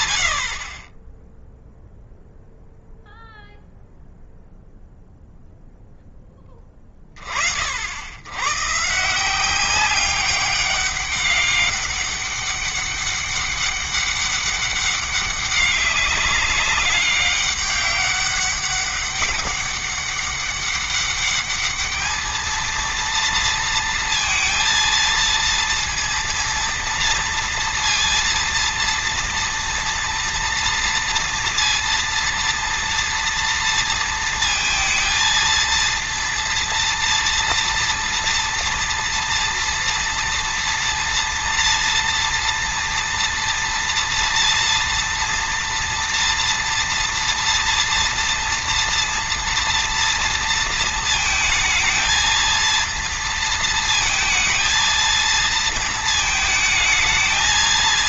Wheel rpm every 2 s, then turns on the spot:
20, 0, 0, 30, 150, 200, 200, 200, 200, 200, 200, 230, 230, 230, 230, 230, 230, 230, 230, 240, 230, 240, 230, 240, 230, 230, 230, 230, 220.
none